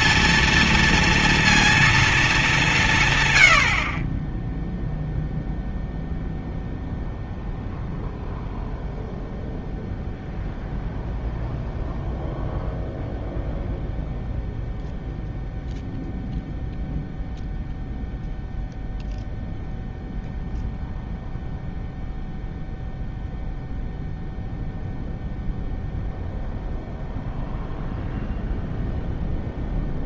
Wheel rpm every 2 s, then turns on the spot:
230, 140, 0, 0, 0, 0, 0, 0, 0, 0, 0, 0, 0, 0, 0.
none